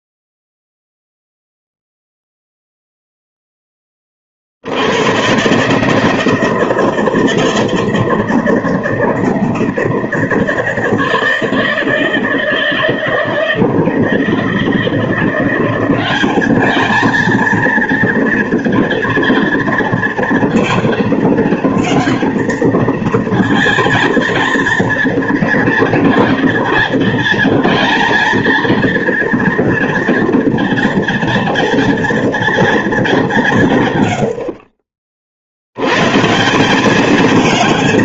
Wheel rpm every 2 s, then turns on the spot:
0, 0, 70, 160, 160, 160, 160, 170, 210, 230, 230, 230, 230, 240, 230, 230, 230, 50, 190.
none